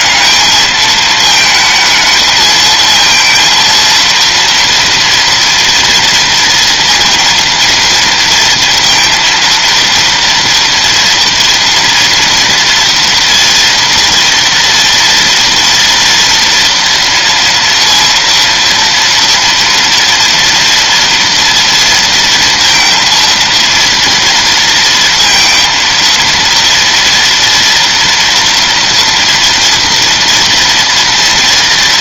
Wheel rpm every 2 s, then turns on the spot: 220, 220, 230, 230, 230, 230, 230, 230, 230, 230, 230, 230, 230, 230, 230, 230.
none